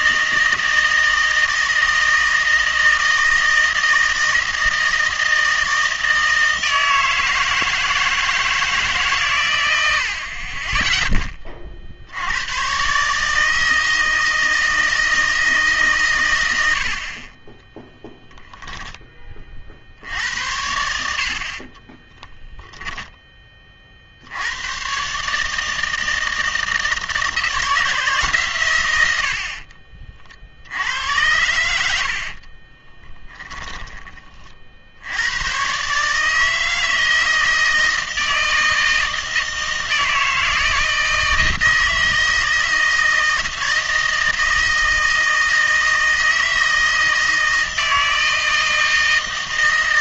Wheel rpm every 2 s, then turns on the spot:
160, 160, 160, 160, 160, 20, 130, 160, 90, 10, 80, 10, 110, 160, 110, 80, 40, 50, 160, 160, 160, 160, 160, 160, 160.
32-34